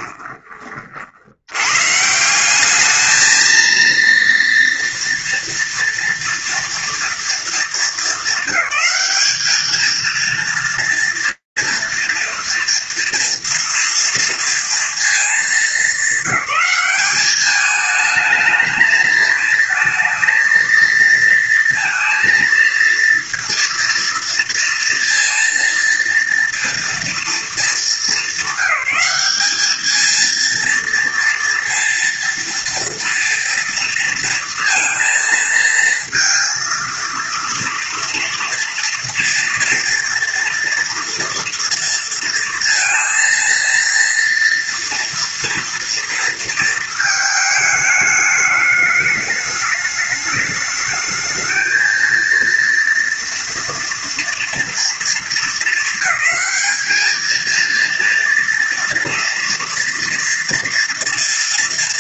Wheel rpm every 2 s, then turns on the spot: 30, 190, 230, 230, 200, 230, 230, 230, 210, 220, 230, 230, 230, 230, 200, 230, 230, 230, 230, 240, 230, 230, 230, 220, 210, 220, 230, 230, 220, 230, 230.
none